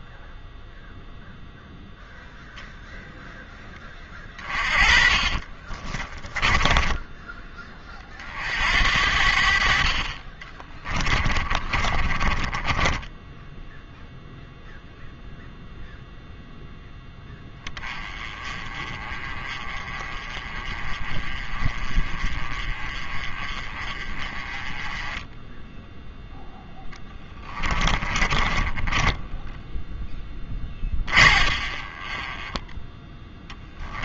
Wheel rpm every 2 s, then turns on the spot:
0, 0, 20, 20, 60, 20, 20, 0, 0, 20, 30, 30, 20, 10, 20, 20, 10.
4-8 10-14 28-34